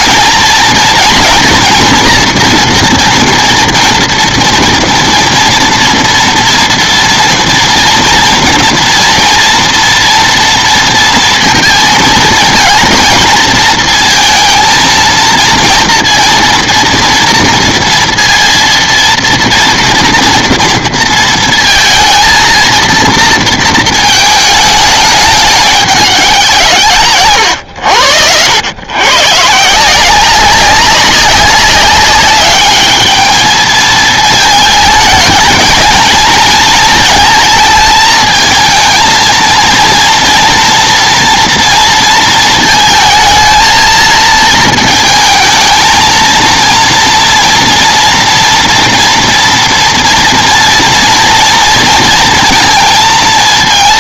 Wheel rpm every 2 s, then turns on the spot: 230, 230, 230, 230, 230, 230, 230, 230, 230, 230, 230, 230, 220, 170, 110, 190, 210, 220, 230, 220, 230, 220, 230, 230, 230, 230, 230.
none